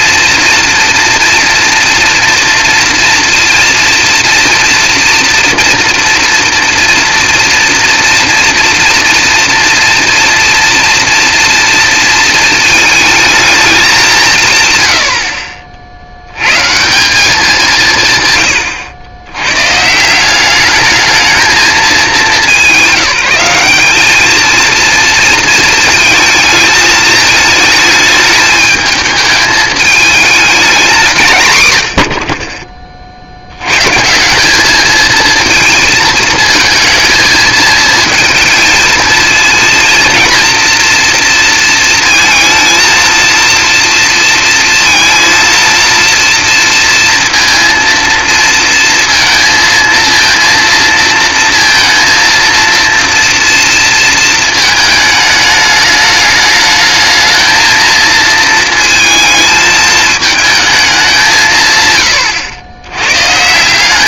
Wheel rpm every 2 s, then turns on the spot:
230, 230, 230, 230, 230, 230, 220, 130, 120, 110, 200, 190, 220, 220, 220, 210, 40, 200, 230, 220, 230, 230, 230, 230, 230, 230, 230, 220, 210, 230, 220, 100.
none